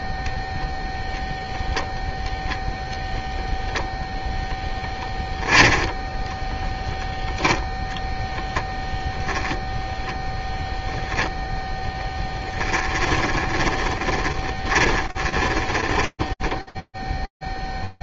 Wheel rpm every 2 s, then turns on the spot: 0, 10, 10, 10, 0, 10, 20, 20, 0.
12-16